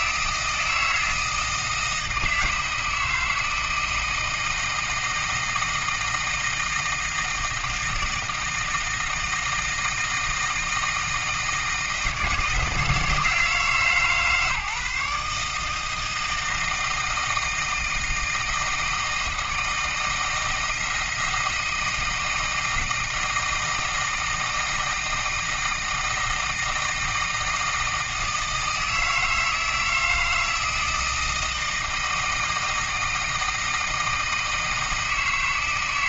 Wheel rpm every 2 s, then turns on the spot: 160, 160, 160, 160, 160, 160, 160, 150, 160, 160, 160, 160, 160, 160, 160, 160, 160, 160.
none